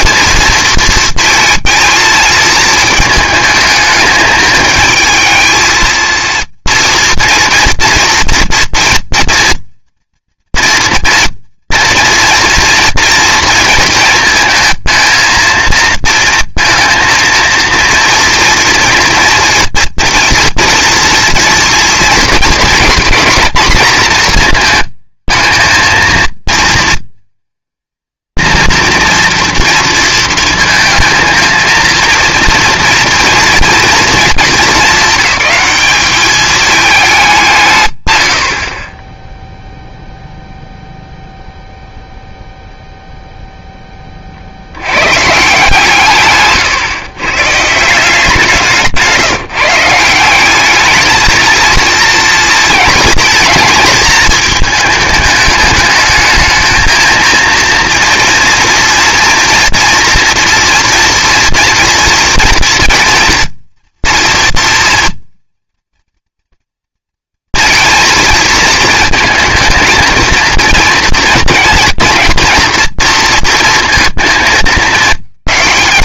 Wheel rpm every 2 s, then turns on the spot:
230, 220, 220, 230, 230, 240, 230, 220, 220, 230, 230, 220, 220, 230, 230, 230, 230, 210, 210, 40, 0, 0, 90, 130, 170, 200, 220, 220, 220, 230, 230, 230, 240, 230, 220, 230, 240, 220.
48-50